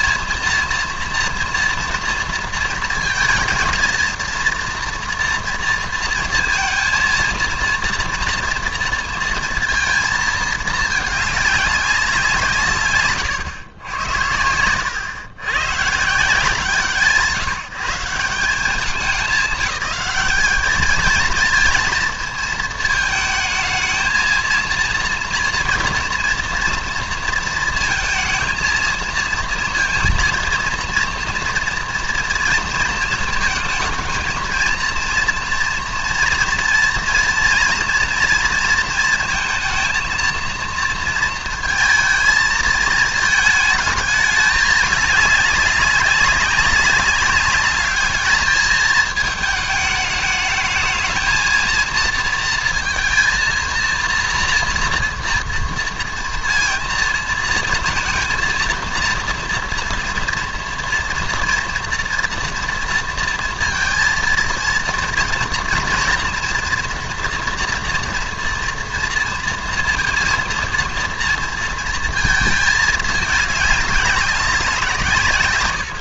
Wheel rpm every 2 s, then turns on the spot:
230, 230, 230, 230, 230, 220, 150, 100, 170, 190, 220, 230, 220, 230, 230, 230, 230, 230, 240, 230, 230, 220, 210, 200, 220, 220, 230, 230, 230, 230, 230, 230, 230, 230, 230, 230, 220, 190.
none